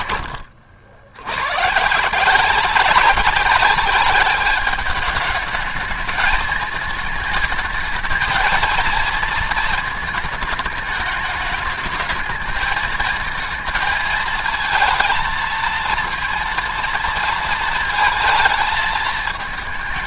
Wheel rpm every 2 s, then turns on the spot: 80, 180, 200, 220, 230, 220, 220, 230, 230, 220.
none